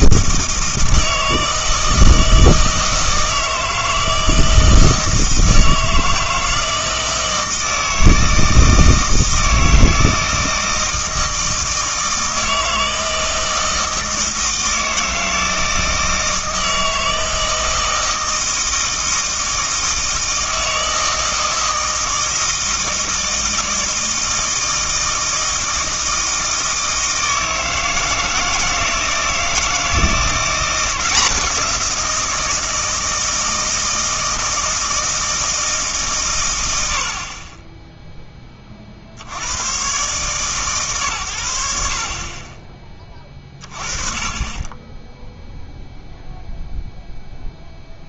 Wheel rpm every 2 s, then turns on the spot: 160, 160, 160, 160, 160, 160, 160, 160, 160, 160, 160, 160, 160, 160, 160, 180, 160, 160, 90, 30, 130, 20, 10, 0.
none